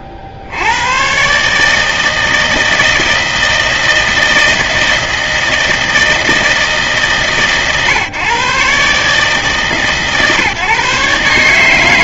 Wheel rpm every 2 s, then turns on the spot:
80, 160, 160, 160, 130, 130.
none